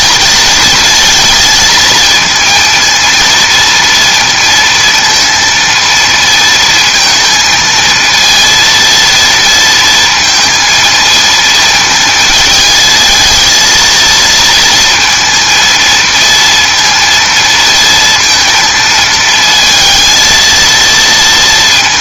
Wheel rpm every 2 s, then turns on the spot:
230, 230, 230, 230, 230, 230, 220, 230, 230, 230, 230.
none